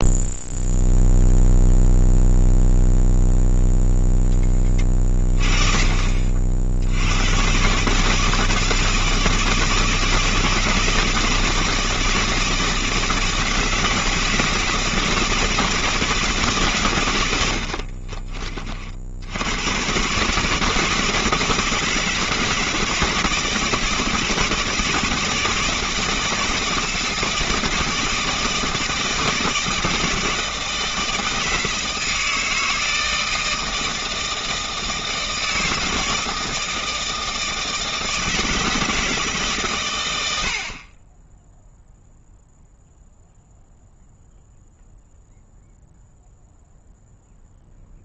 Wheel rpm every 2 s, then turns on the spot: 0, 0, 30, 80, 160, 160, 160, 160, 120, 60, 160, 160, 160, 160, 160, 160, 160, 160, 160, 160, 30, 0, 0, 0.
none